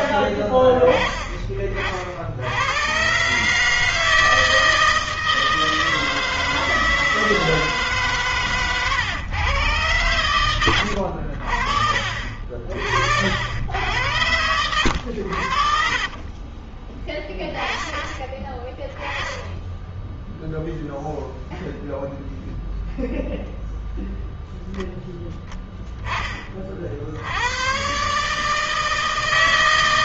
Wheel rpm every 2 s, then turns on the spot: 20, 70, 160, 160, 130, 100, 40, 90, 30, 30, 10, 0, 0, 20, 150.
8-10